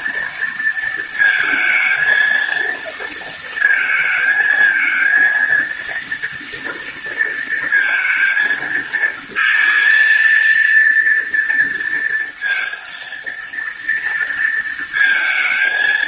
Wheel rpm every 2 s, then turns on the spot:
230, 230, 230, 230, 220, 230, 230, 220.
none